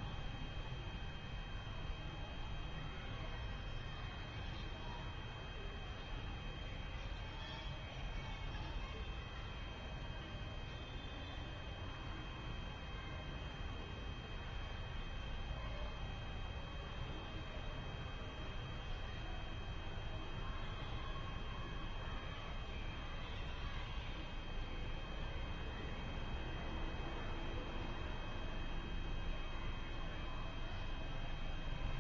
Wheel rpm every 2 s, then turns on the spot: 0, 0, 0, 0, 0, 0, 0, 0, 0, 0, 0, 0, 0, 0, 0, 0.
none